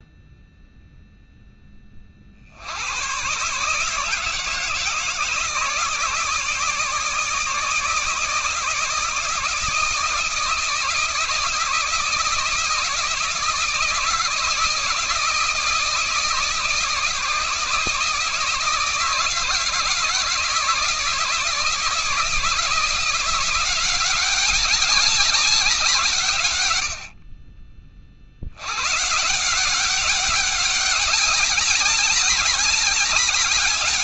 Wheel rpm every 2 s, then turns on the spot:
0, 90, 160, 160, 160, 160, 160, 160, 160, 150, 160, 160, 190, 110, 90, 190, 200.
none